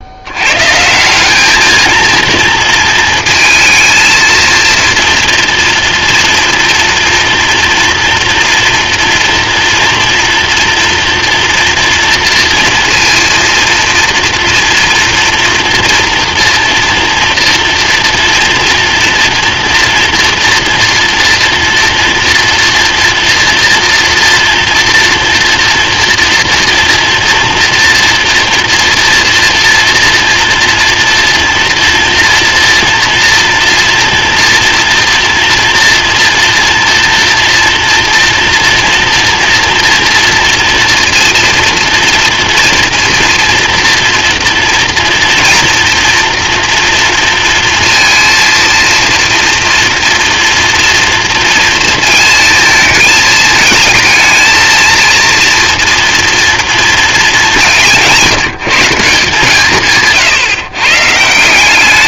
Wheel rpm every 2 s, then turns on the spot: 130, 230, 230, 230, 230, 230, 230, 240, 230, 230, 230, 230, 230, 230, 230, 230, 230, 240, 230, 230, 240, 230, 230, 230, 230, 230, 220, 220, 230, 170, 140.
none